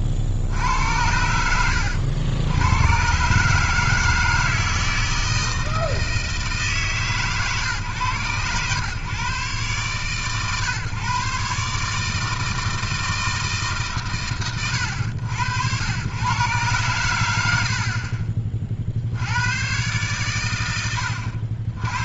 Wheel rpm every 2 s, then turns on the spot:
50, 80, 160, 160, 120, 120, 160, 140, 110, 20, 120.
none